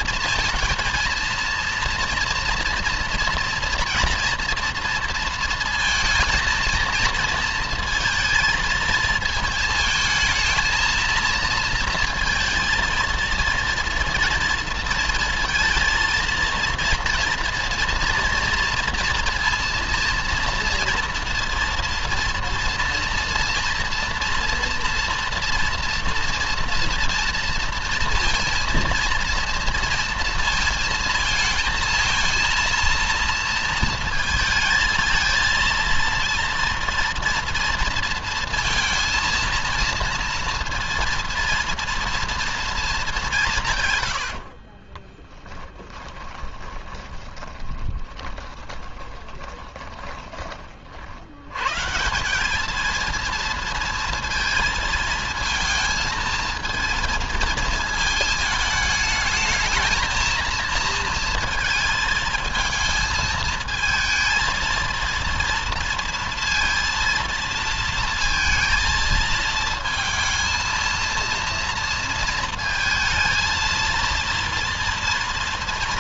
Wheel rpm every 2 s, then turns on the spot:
230, 230, 230, 230, 230, 220, 230, 230, 230, 240, 230, 230, 230, 230, 230, 230, 230, 220, 230, 230, 230, 220, 40, 20, 20, 50, 220, 230, 230, 220, 230, 220, 230, 230, 230, 230, 230, 230.
44-50